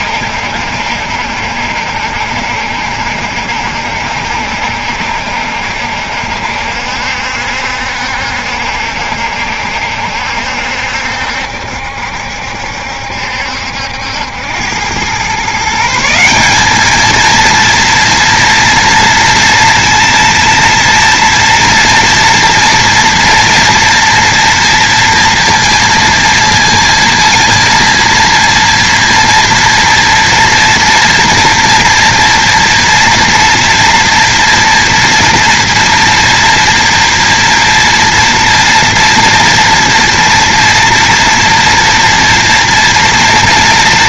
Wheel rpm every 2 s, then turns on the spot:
60, 60, 70, 70, 70, 70, 70, 110, 220, 230, 230, 230, 230, 230, 230, 230, 230, 230, 230, 230, 230, 230.
none